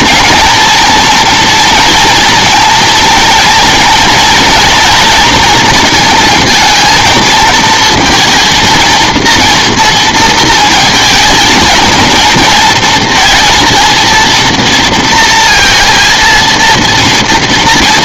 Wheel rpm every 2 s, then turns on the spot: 230, 230, 230, 230, 230, 230, 230, 230, 230.
none